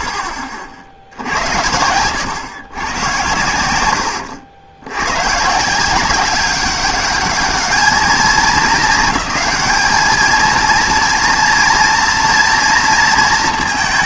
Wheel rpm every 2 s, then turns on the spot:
40, 100, 100, 200, 210, 230, 230.
none